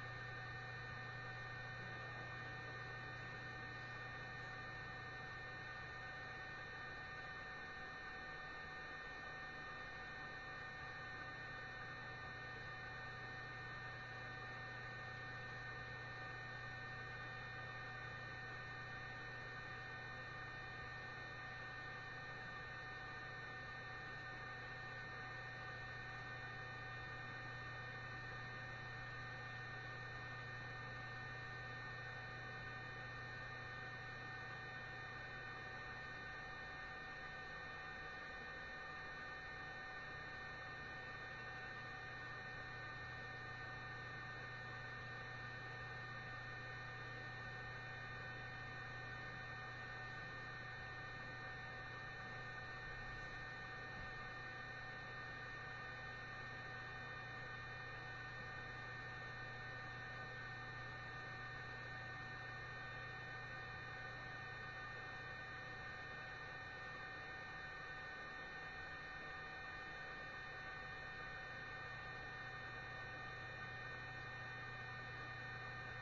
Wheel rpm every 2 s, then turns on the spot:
0, 0, 0, 0, 0, 0, 0, 0, 0, 0, 0, 0, 0, 0, 0, 0, 0, 0, 0, 0, 0, 0, 0, 0, 0, 0, 0, 0, 0, 0, 0, 0, 0, 0, 0, 0, 0, 0.
none